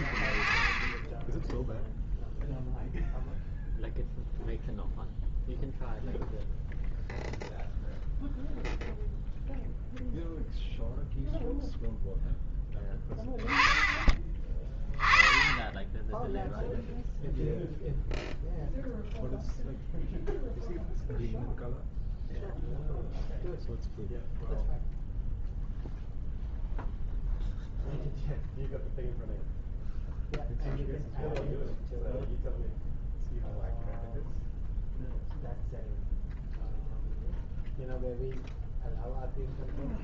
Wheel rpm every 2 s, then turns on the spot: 0, 0, 0, 0, 0, 0, 10, 30, 0, 0, 0, 0, 0, 0, 0, 0, 0, 0, 0, 0.
none